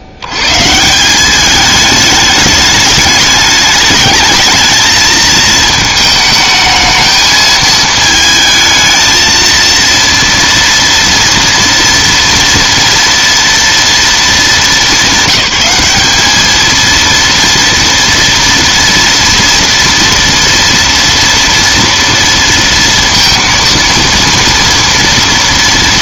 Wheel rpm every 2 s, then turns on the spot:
90, 210, 220, 220, 220, 230, 230, 200, 230, 240, 230, 230, 230.
none